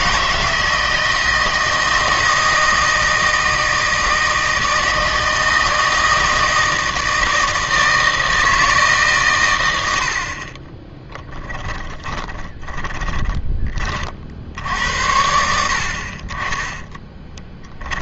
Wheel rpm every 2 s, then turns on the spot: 160, 160, 160, 160, 160, 30, 20, 60, 20.
10-14